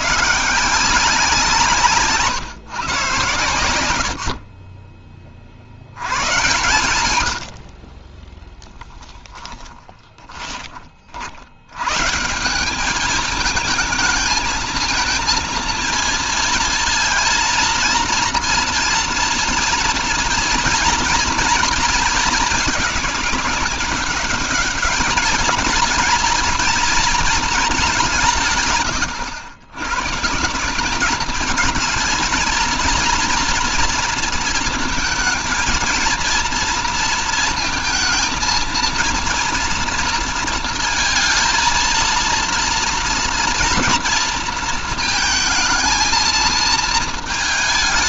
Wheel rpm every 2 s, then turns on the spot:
170, 120, 30, 100, 10, 30, 190, 220, 230, 240, 230, 210, 210, 230, 130, 190, 230, 230, 230, 230, 230, 230, 230, 220.
8-10